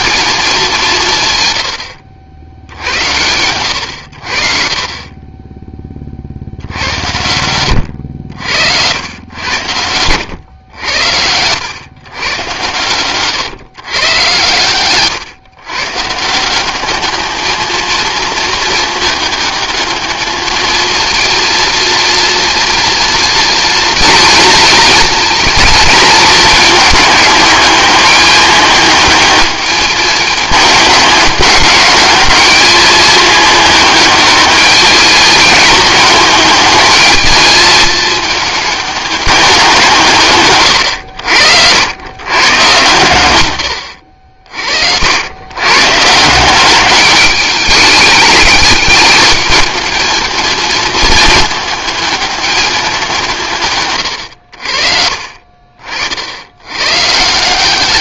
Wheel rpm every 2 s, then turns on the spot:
200, 80, 40, 70, 80, 100, 120, 120, 190, 220, 220, 230, 230, 220, 210, 210, 210, 210, 220, 210, 110, 120, 60, 190, 210, 220, 210, 70, 90.
40-42